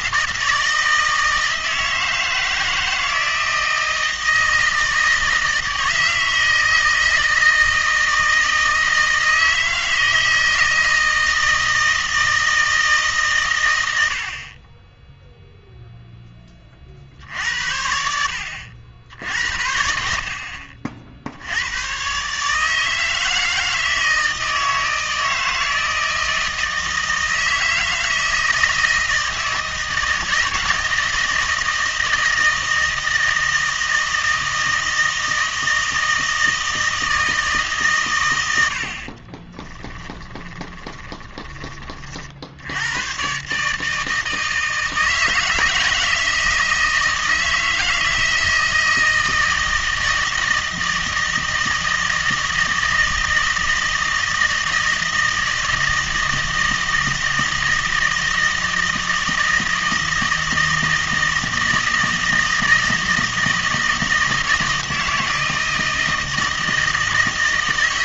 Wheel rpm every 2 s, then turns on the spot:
160, 160, 160, 160, 160, 160, 160, 30, 30, 70, 50, 150, 160, 160, 160, 160, 160, 160, 160, 80, 20, 80, 160, 160, 160, 160, 160, 160, 160, 160, 160, 160, 160, 160.
40-42